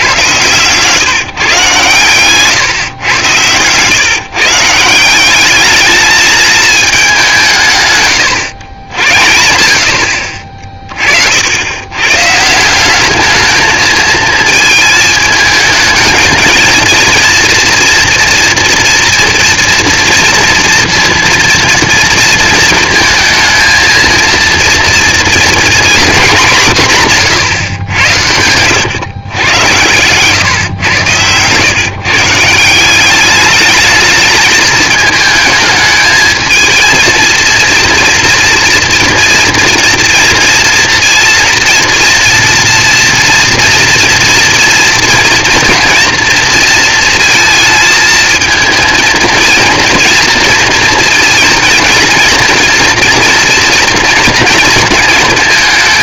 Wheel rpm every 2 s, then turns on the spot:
140, 140, 160, 220, 110, 50, 170, 220, 230, 230, 230, 230, 230, 180, 100, 120, 170, 210, 220, 230, 230, 230, 230, 230, 220, 230, 230, 230.
30-32